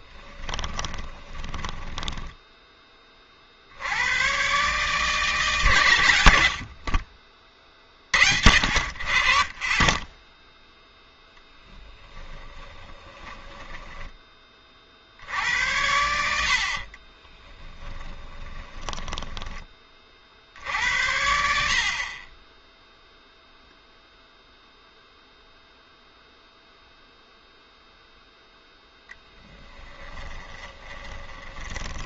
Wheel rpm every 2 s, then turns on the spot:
10, 10, 140, 60, 60, 0, 20, 40, 50, 10, 70, 10, 0, 0, 0, 20.
0-2 12-14 18-20 30-32